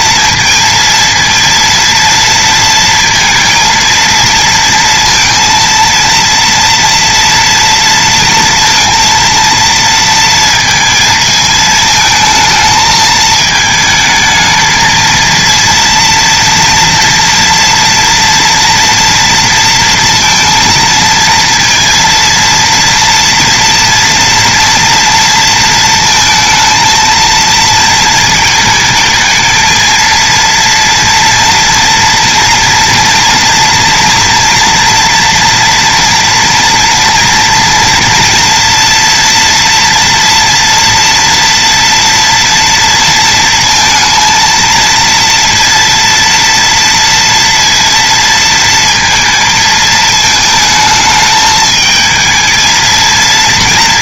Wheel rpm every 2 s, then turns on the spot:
230, 230, 230, 230, 230, 220, 220, 220, 230, 230, 230, 230, 230, 220, 220, 230, 230, 230, 230, 230, 230, 230, 230, 230, 230, 220, 230.
none